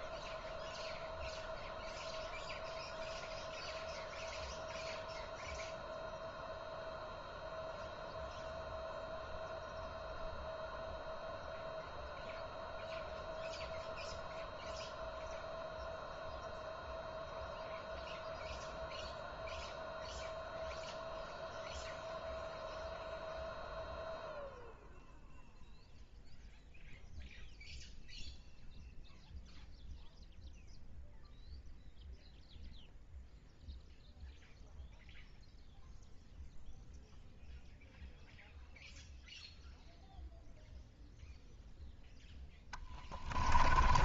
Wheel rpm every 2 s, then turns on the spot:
0, 0, 0, 0, 0, 0, 0, 0, 0, 0, 0, 0, 0, 0, 0, 0, 0, 0, 0, 0, 0, 0.
none